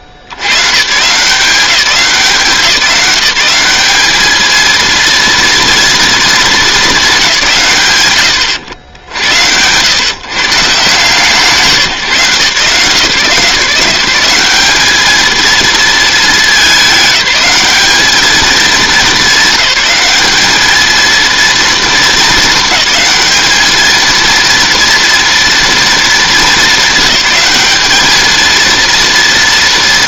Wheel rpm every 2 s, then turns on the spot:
110, 160, 230, 220, 90, 170, 150, 200, 210, 210, 210, 210, 230, 200, 220.
none